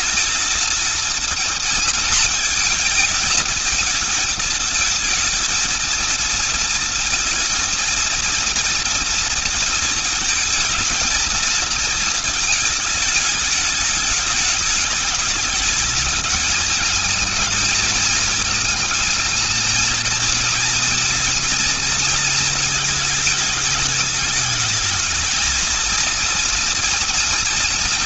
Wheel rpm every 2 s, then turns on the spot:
220, 220, 230, 230, 230, 220, 220, 210, 220, 220, 230, 230, 220, 230.
none